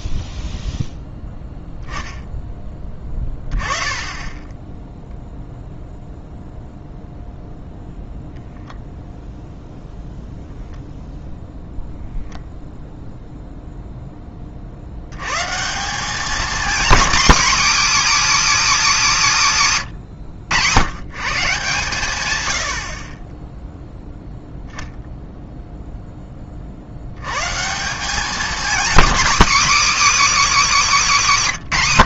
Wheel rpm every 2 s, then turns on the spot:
0, 0, 10, 0, 0, 0, 0, 10, 190, 270, 160, 140, 0, 0, 170, 300.
none